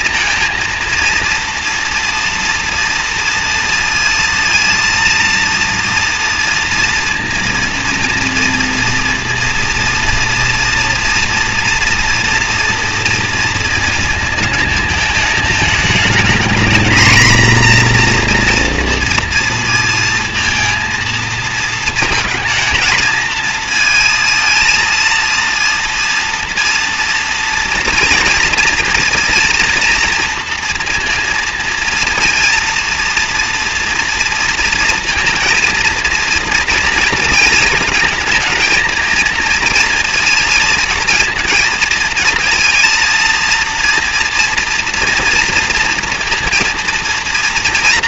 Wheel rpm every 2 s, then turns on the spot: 230, 230, 230, 230, 230, 230, 230, 220, 230, 240, 230, 220, 230, 230, 230, 230, 230, 230, 230, 230, 230, 230, 230, 240.
none